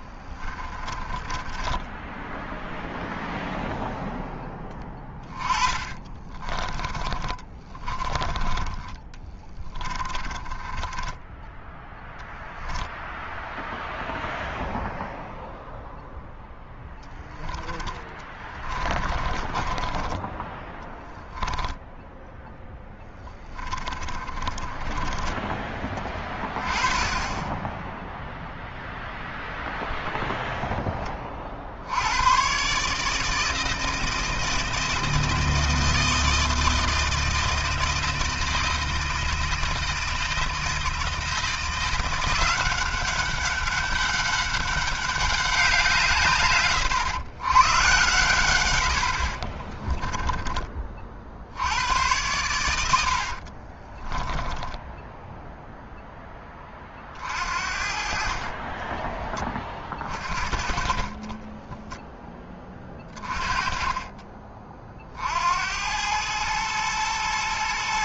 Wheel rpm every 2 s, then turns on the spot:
20, 0, 10, 20, 20, 20, 0, 0, 10, 20, 10, 10, 20, 20, 0, 0, 130, 160, 160, 160, 160, 180, 200, 120, 100, 20, 100, 10, 20, 30, 50, 20, 30, 110.
0-2 4-8 10-12 18-22 24-26 54-56